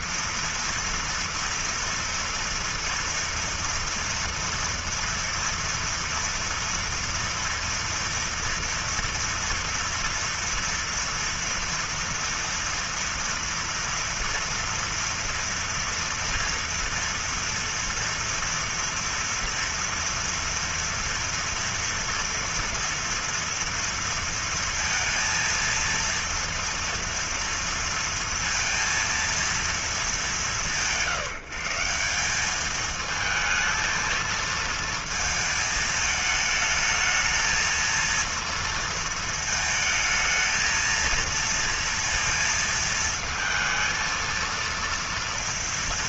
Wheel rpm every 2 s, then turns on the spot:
230, 240, 230, 230, 230, 230, 230, 230, 230, 230, 230, 230, 230, 230, 230, 180, 190, 220, 220, 230, 220, 230, 230.
none